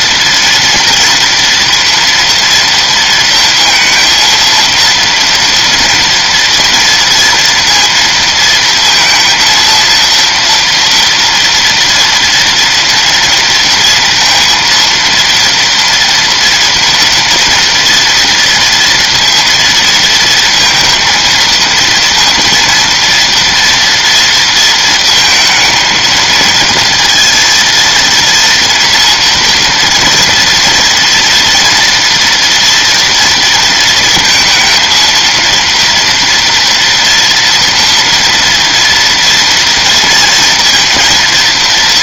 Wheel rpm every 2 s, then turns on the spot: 230, 230, 230, 230, 230, 230, 230, 230, 240, 230, 230, 230, 230, 230, 230, 230, 240, 230, 240, 230, 230.
none